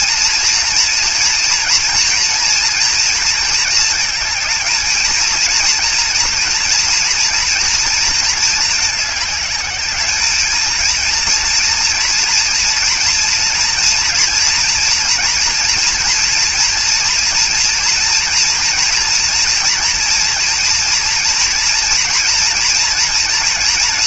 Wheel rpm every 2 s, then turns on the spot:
230, 230, 230, 230, 220, 230, 230, 240, 240, 240, 240, 230.
none